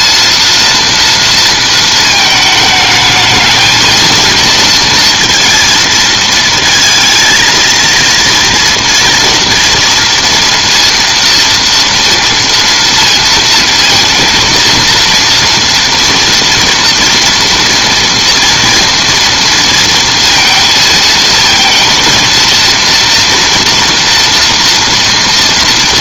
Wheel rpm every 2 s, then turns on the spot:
230, 220, 230, 220, 230, 230, 230, 230, 230, 230, 230, 230, 240.
none